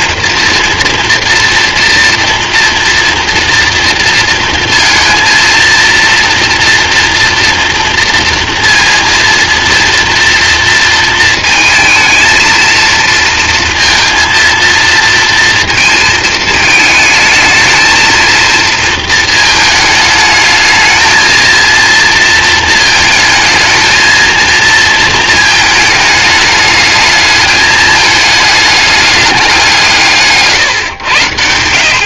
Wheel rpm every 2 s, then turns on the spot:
230, 240, 230, 230, 230, 230, 230, 230, 220, 230, 220, 220, 230, 210, 210, 150.
30-32